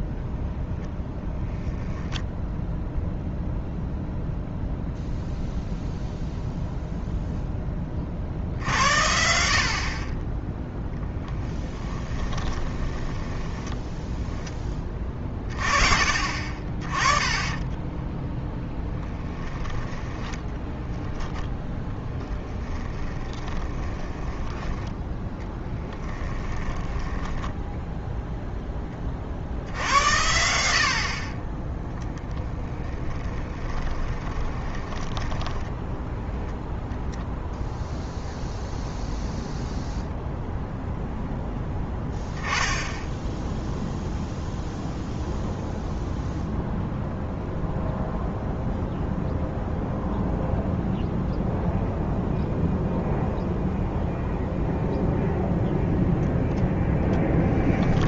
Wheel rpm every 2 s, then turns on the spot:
0, 0, 0, 0, 70, 0, 20, 10, 30, 0, 20, 10, 10, 10, 10, 70, 0, 20, 0, 0, 0, 10, 0, 0, 0, 0, 0, 0, 0.
12-14 20-24 26-28 34-36